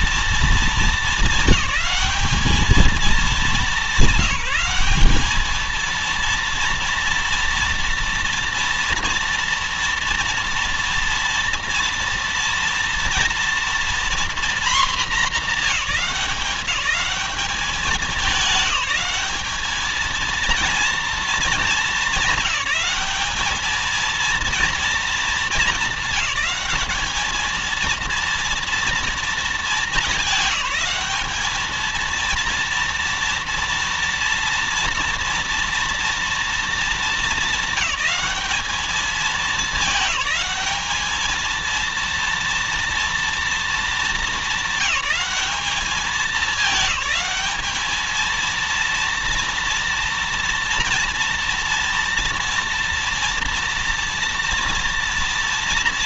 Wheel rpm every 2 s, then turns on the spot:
210, 210, 190, 230, 230, 230, 230, 240, 210, 210, 230, 210, 230, 210, 230, 200, 230, 230, 220, 210, 210, 230, 200, 210, 230, 240, 230, 230.
none